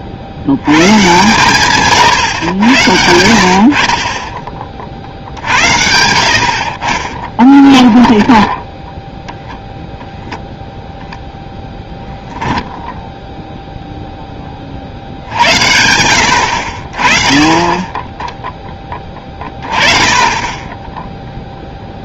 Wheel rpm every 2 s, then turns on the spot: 90, 90, 30, 50, 20, 0, 0, 30, 70, 10, 10.
6-10